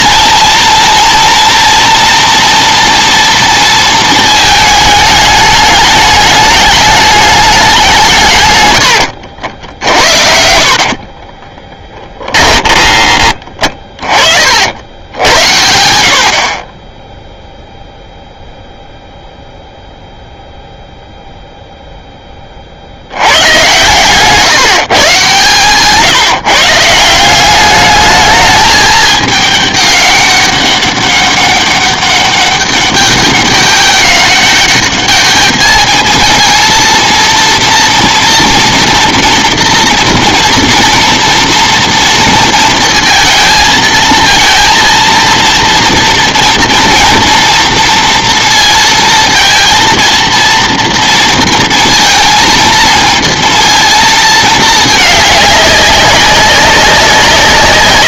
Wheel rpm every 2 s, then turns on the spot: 230, 240, 210, 210, 110, 50, 20, 70, 30, 0, 0, 60, 140, 170, 210, 200, 200, 200, 230, 230, 230, 230, 230, 230, 230, 230, 230, 220, 190.
10-14